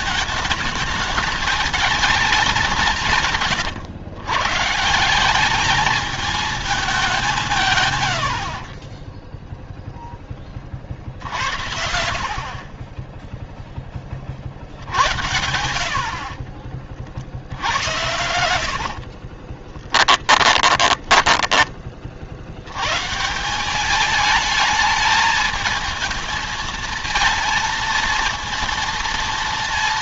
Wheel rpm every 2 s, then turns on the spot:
210, 180, 160, 210, 50, 50, 30, 70, 40, 60, 10, 110, 220, 220, 230.
18-22